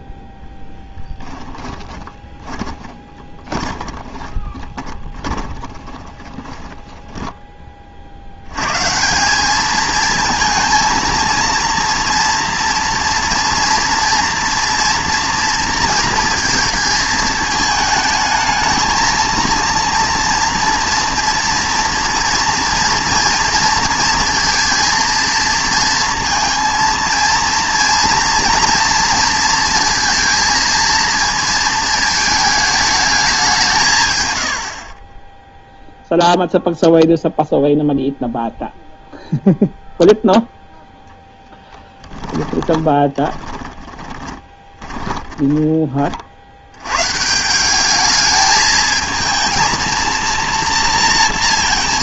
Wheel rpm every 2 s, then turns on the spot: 0, 20, 20, 10, 120, 230, 230, 240, 230, 220, 230, 230, 230, 230, 230, 230, 220, 80, 0, 0, 0, 20, 20, 90, 220, 230.
2-8 42-46